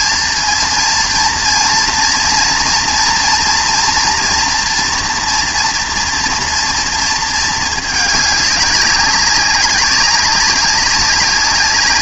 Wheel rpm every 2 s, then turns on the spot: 230, 230, 230, 230, 200, 200.
none